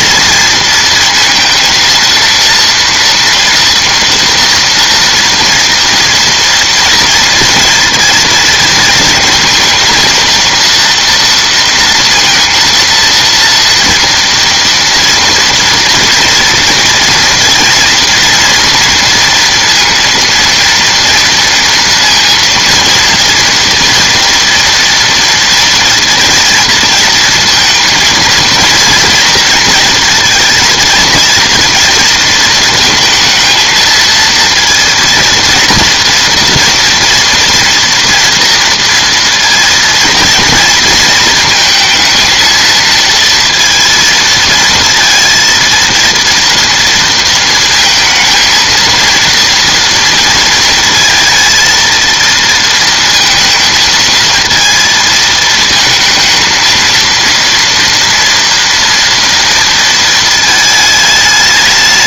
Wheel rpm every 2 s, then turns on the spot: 230, 230, 230, 230, 230, 230, 230, 230, 230, 230, 230, 230, 230, 230, 230, 230, 220, 230, 230, 230, 230, 220, 220, 230, 230, 230, 230, 230, 220, 230, 220.
none